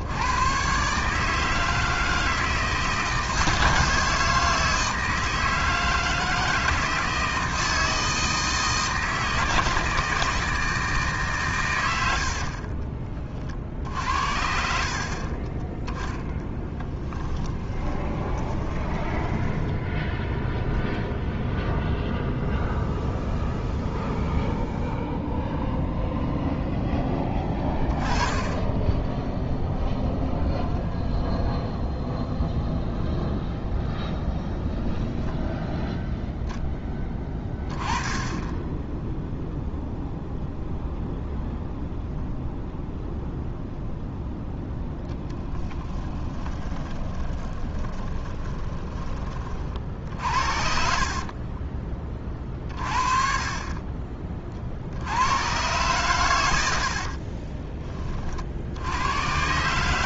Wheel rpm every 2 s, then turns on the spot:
130, 160, 160, 160, 160, 160, 30, 50, 20, 20, 0, 0, 0, 0, 10, 0, 0, 0, 10, 10, 0, 0, 0, 20, 10, 50, 30, 50, 80, 60.
12-14 16-20 46-52 56-58